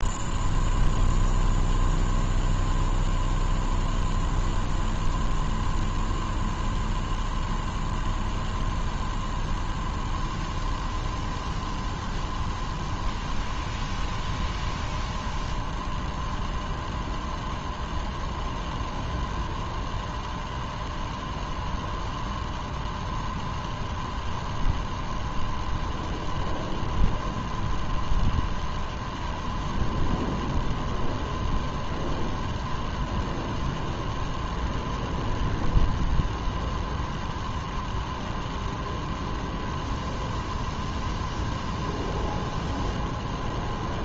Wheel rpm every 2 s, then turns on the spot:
0, 0, 0, 0, 0, 0, 0, 0, 0, 0, 0, 0, 0, 0, 0, 0, 0, 0, 0, 0, 0, 0.
none